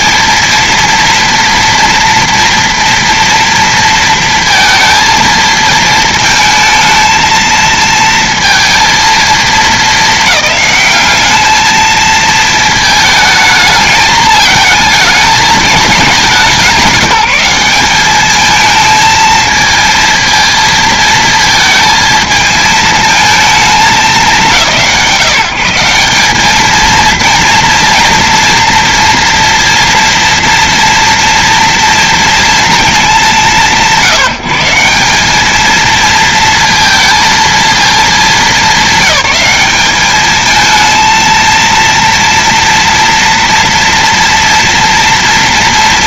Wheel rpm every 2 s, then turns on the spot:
230, 230, 230, 230, 230, 200, 220, 220, 180, 220, 220, 220, 170, 220, 230, 230, 220, 170, 230, 190, 220, 230, 230.
none